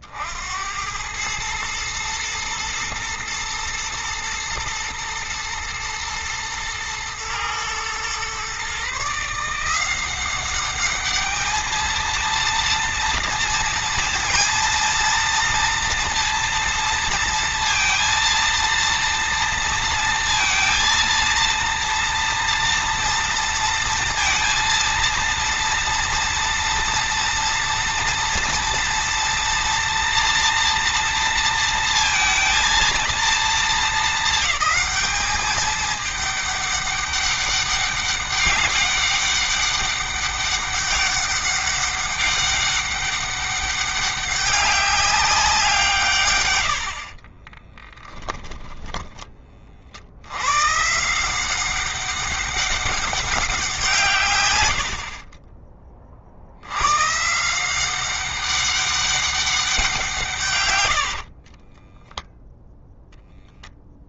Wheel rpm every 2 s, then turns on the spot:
100, 110, 110, 110, 140, 200, 230, 230, 230, 230, 230, 230, 230, 230, 230, 230, 230, 210, 200, 200, 200, 200, 190, 60, 10, 130, 200, 60, 100, 200, 90, 0.
46-50 60-62